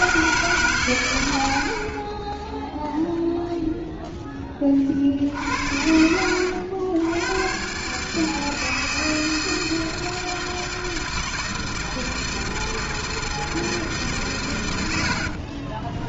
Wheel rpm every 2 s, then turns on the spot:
10, 60, 90, 160, 160, 160, 120, 10.
14-16